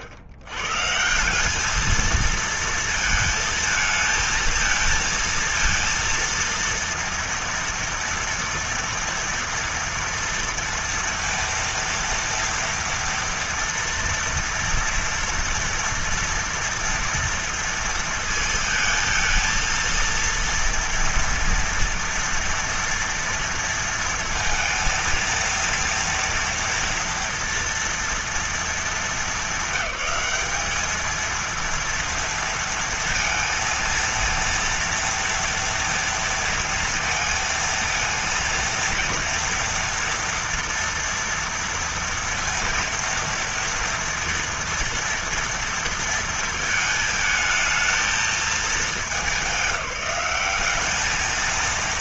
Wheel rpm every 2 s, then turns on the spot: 100, 230, 230, 230, 230, 230, 230, 230, 230, 220, 230, 230, 230, 230, 220, 200, 230, 230, 230, 230, 230, 230, 230, 220, 210, 190.
none